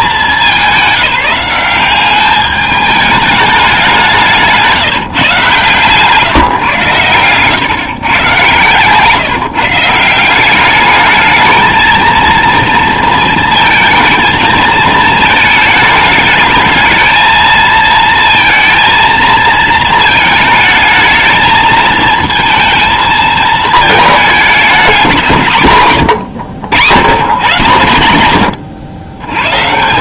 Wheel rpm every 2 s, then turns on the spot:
200, 210, 170, 120, 130, 200, 230, 220, 220, 230, 220, 220, 200, 110, 100.
8-10